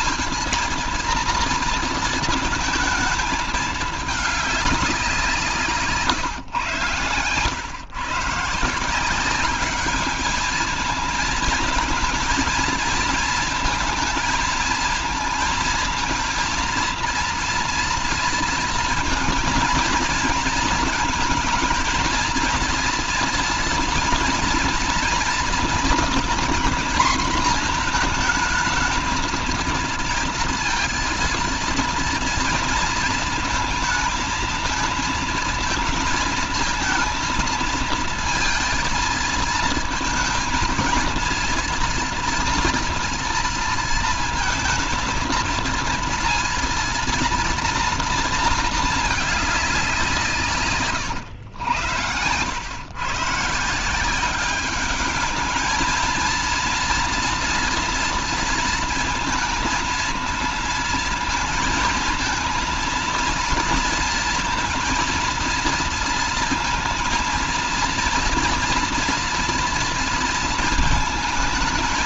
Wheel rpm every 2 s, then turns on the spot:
230, 220, 200, 120, 160, 220, 230, 220, 230, 230, 220, 230, 230, 230, 220, 230, 220, 220, 230, 230, 220, 240, 220, 230, 220, 150, 110, 200, 230, 230, 230, 230, 230, 230, 230, 220.
50-52